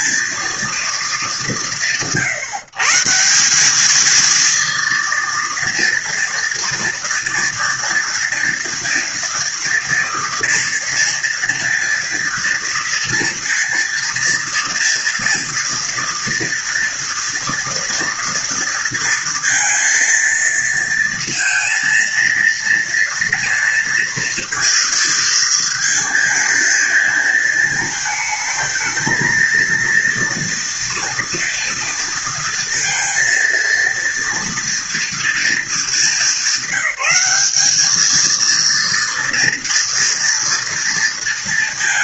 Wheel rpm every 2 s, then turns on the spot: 190, 140, 230, 230, 230, 230, 230, 230, 230, 230, 230, 230, 230, 230, 220, 230, 230, 240, 210, 230, 230.
none